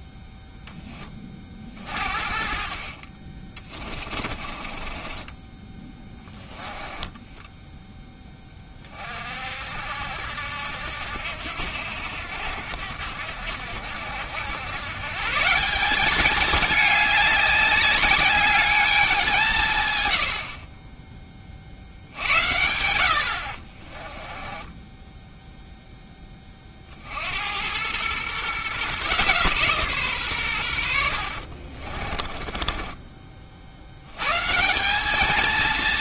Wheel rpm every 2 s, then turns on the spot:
10, 40, 30, 10, 30, 70, 70, 110, 210, 210, 30, 80, 10, 40, 140, 100, 20, 180.
4-8 24-26 32-34